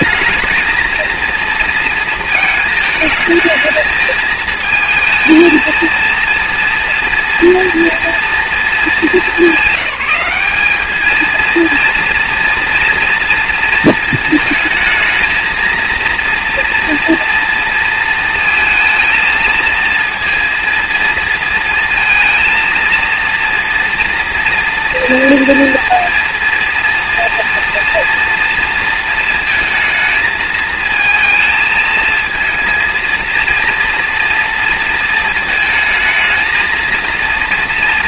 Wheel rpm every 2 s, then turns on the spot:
230, 220, 220, 230, 210, 220, 230, 220, 240, 220, 230, 230, 240, 230, 220, 220, 230, 230, 230.
none